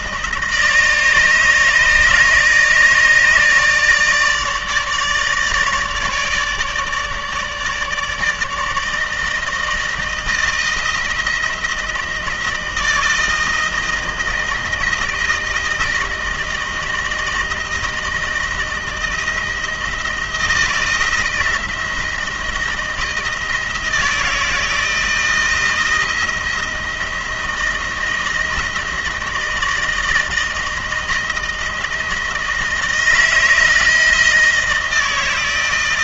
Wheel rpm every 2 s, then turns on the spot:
160, 150, 150, 150, 160, 160, 160, 160, 160, 160, 160, 160, 160, 170, 160, 160, 160, 160.
none